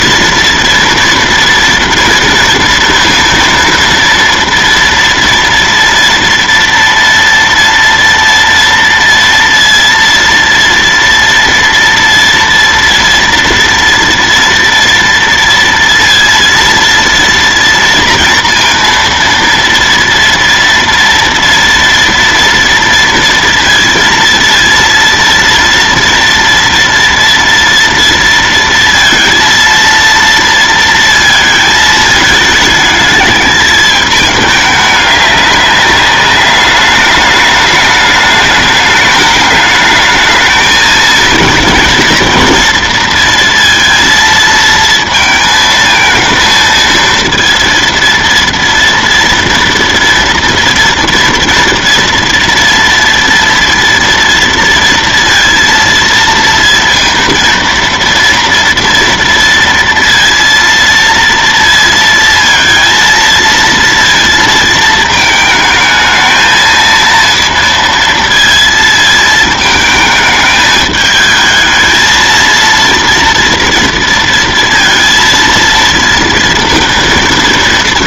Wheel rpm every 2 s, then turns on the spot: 230, 230, 230, 230, 230, 230, 230, 230, 230, 230, 230, 230, 230, 230, 230, 230, 210, 210, 200, 210, 220, 230, 230, 230, 230, 230, 230, 230, 230, 230, 230, 230, 220, 220, 220, 220, 230, 230, 230.
none